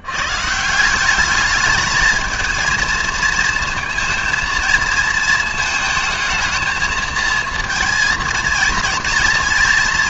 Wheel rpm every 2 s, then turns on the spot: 170, 220, 230, 220, 230.
none